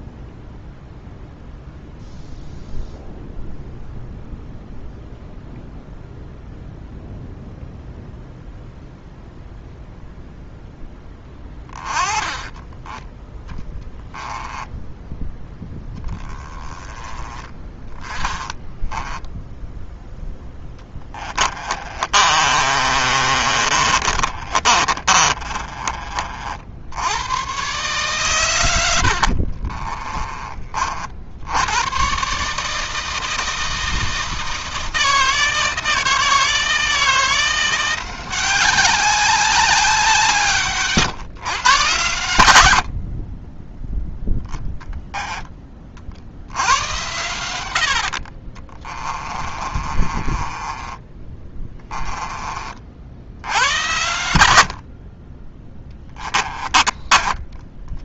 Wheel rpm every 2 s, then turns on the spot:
0, 0, 0, 0, 0, 10, 10, 10, 20, 10, 20, 30, 30, 80, 100, 50, 160, 160, 160, 190, 150, 70, 10, 100, 30, 20, 20, 80, 20.
12-16 18-26 48-52 56-58